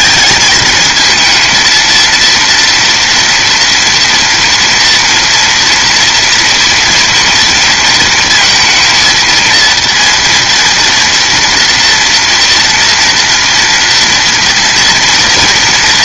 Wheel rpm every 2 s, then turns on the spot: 220, 230, 230, 230, 230, 230, 230, 230.
none